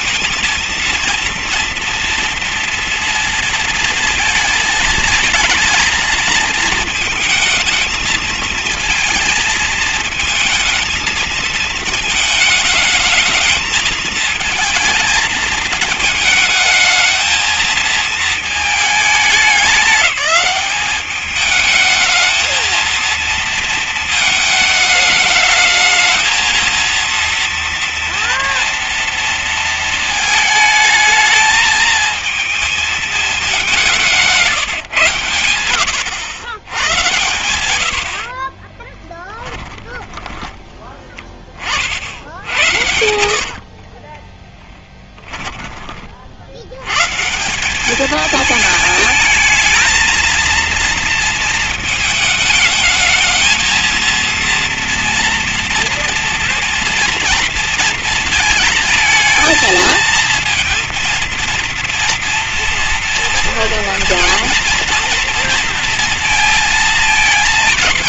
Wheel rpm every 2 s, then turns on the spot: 230, 240, 220, 220, 220, 220, 220, 230, 220, 210, 200, 230, 220, 230, 240, 220, 220, 140, 110, 20, 10, 60, 20, 120, 220, 230, 220, 240, 230, 220, 230, 230, 230, 220.
36-40 42-46